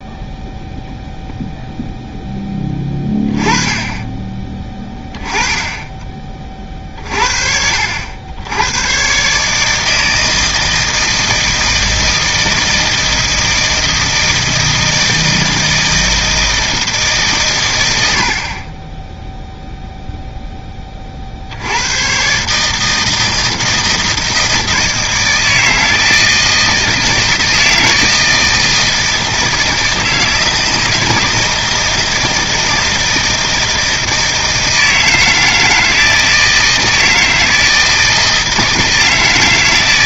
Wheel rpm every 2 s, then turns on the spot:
0, 20, 10, 50, 100, 160, 160, 160, 160, 10, 20, 150, 160, 160, 160, 160, 160, 160, 160, 160.
none